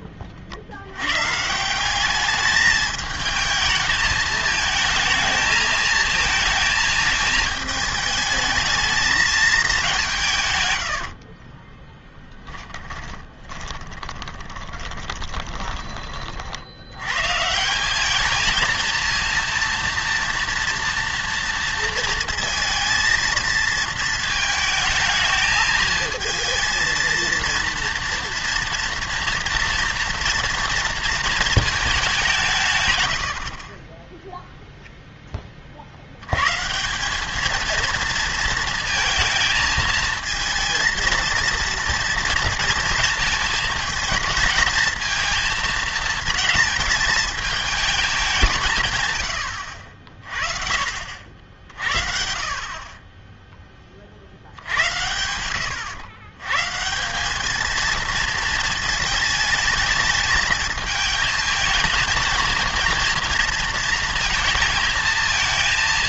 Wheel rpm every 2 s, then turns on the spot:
70, 210, 220, 220, 220, 110, 20, 20, 70, 230, 240, 230, 220, 230, 230, 230, 140, 0, 150, 230, 230, 230, 220, 220, 150, 50, 50, 80, 140, 220, 220, 230, 220.
12-16